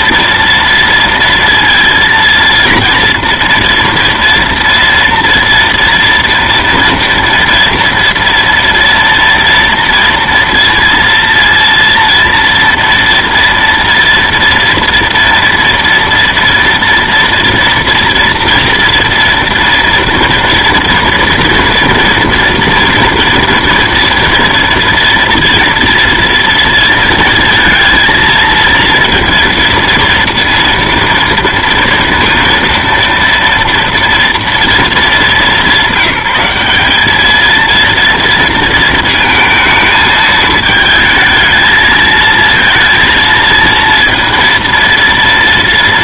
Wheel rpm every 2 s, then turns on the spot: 230, 230, 230, 230, 230, 230, 230, 230, 230, 230, 230, 230, 230, 230, 230, 230, 230, 230, 200, 230, 220, 230, 230.
none